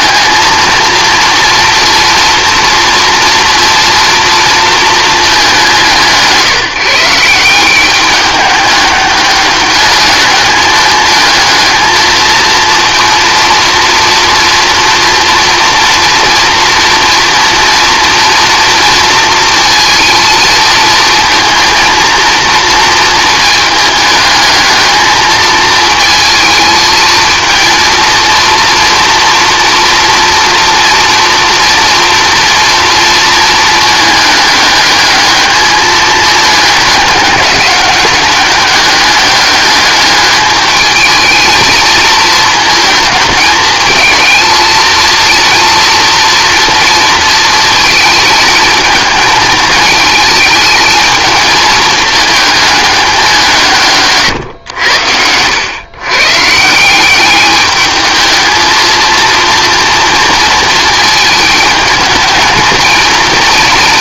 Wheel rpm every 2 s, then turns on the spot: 230, 230, 230, 170, 200, 220, 230, 230, 230, 230, 230, 230, 220, 220, 230, 230, 240, 210, 210, 200, 210, 220, 230, 230, 220, 220, 210, 100, 150, 220, 230, 220.
none